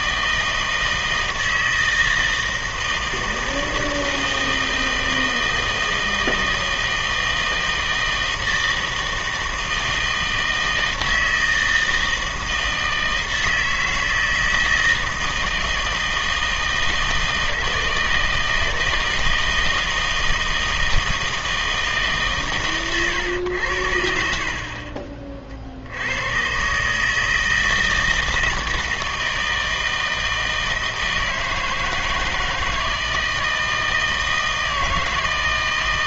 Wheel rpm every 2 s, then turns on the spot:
160, 160, 160, 160, 160, 160, 160, 160, 160, 160, 160, 120, 40, 140, 160, 160, 160, 160.
none